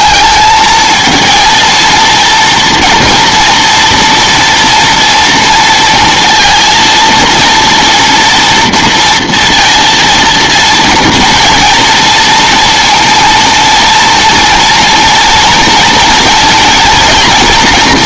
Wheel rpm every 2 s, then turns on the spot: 230, 240, 230, 230, 230, 230, 230, 230, 240.
none